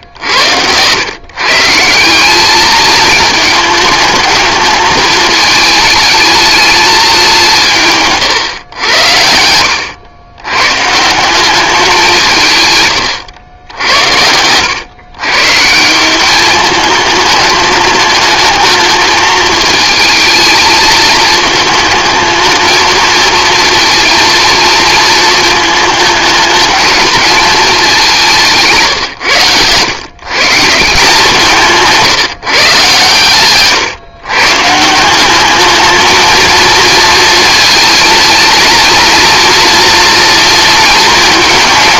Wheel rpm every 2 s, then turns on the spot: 110, 220, 210, 210, 100, 130, 140, 110, 210, 220, 220, 220, 230, 220, 150, 170, 130, 160, 230, 230, 220.
28-30